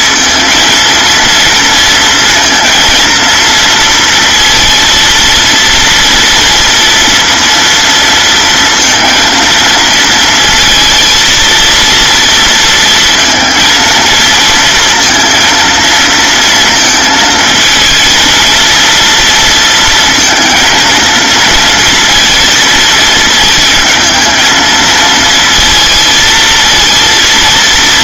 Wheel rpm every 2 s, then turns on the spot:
230, 230, 230, 230, 230, 230, 230, 230, 230, 230, 230, 220, 220, 230.
none